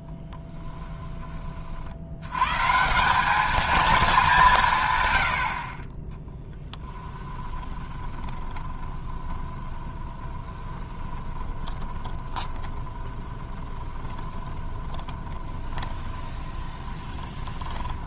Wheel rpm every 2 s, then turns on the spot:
10, 150, 160, 10, 20, 20, 30, 20, 20.
0-2 6-18